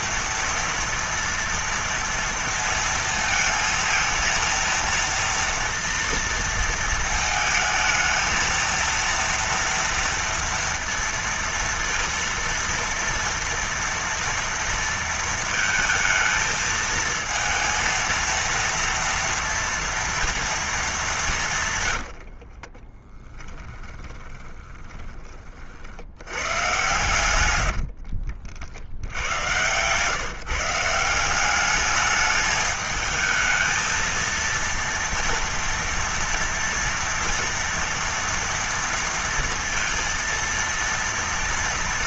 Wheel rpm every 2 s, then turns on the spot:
230, 230, 230, 230, 220, 240, 230, 230, 230, 230, 230, 110, 10, 80, 70, 130, 210, 230, 230, 230, 230.
24-26 28-30